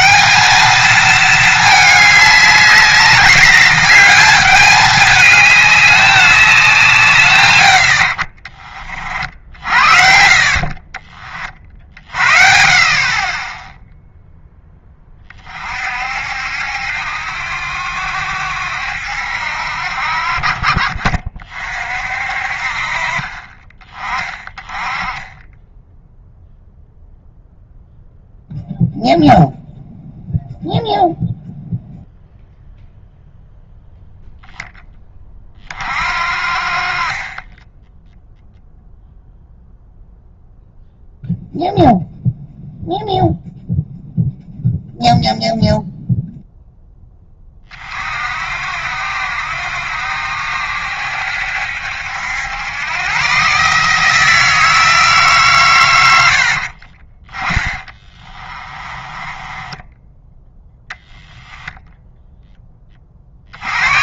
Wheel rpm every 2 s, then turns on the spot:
210, 200, 210, 190, 40, 30, 50, 10, 70, 70, 40, 50, 20, 0, 0, 0, 0, 10, 40, 0, 0, 0, 0, 0, 60, 70, 100, 160, 50, 30, 10, 20.
10-12 56-60